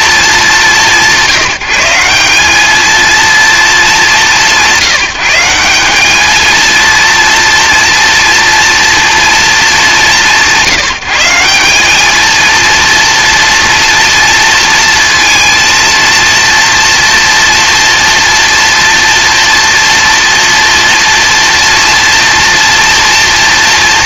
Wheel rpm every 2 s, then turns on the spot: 200, 210, 180, 220, 230, 170, 230, 230, 230, 230, 230, 230.
none